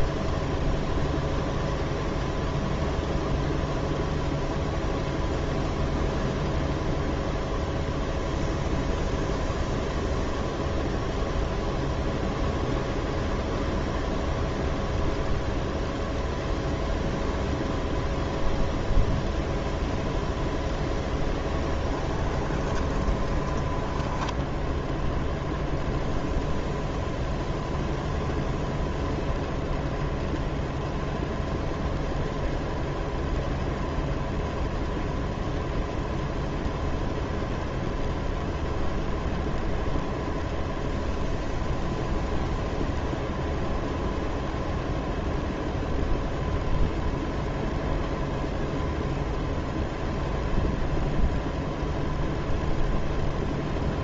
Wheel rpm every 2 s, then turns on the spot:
0, 0, 0, 0, 0, 0, 0, 0, 0, 0, 0, 10, 0, 0, 0, 0, 0, 0, 0, 0, 0, 0, 0, 0, 0, 0, 0.
22-24